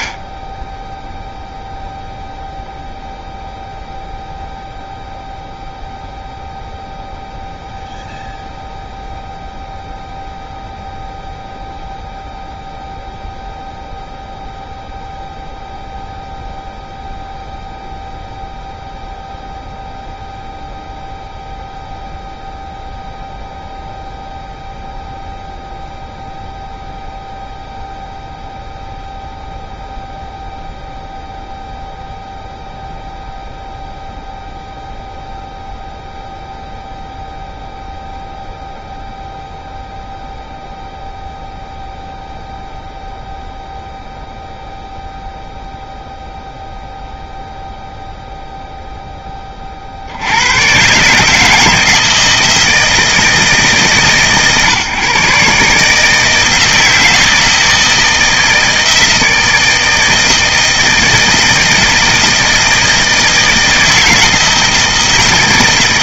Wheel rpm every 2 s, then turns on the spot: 10, 0, 0, 0, 0, 0, 0, 0, 0, 0, 0, 0, 0, 0, 0, 0, 0, 0, 0, 0, 0, 0, 0, 0, 0, 110, 160, 140, 160, 160, 160, 160, 160.
none